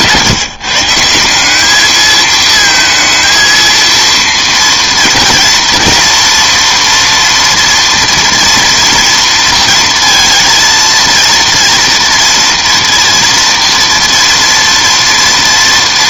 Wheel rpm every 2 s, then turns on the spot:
160, 230, 230, 230, 230, 230, 240, 240.
none